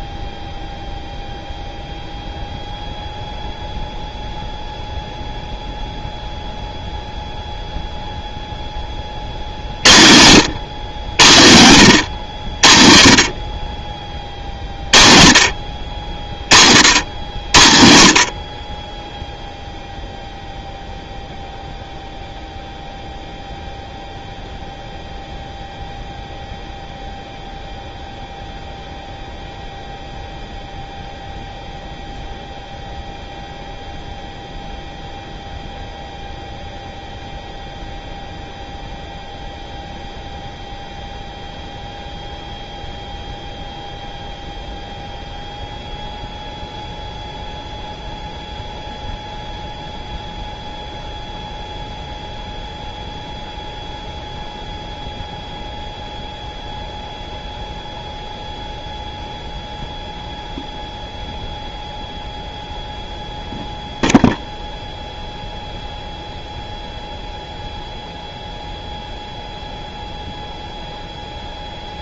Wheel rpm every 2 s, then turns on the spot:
0, 0, 0, 0, 0, 100, 80, 40, 40, 30, 0, 0, 0, 0, 0, 0, 0, 0, 0, 0, 0, 0, 0, 0, 0, 0, 0, 0, 0, 0, 0, 0, 0, 0, 0, 0.
none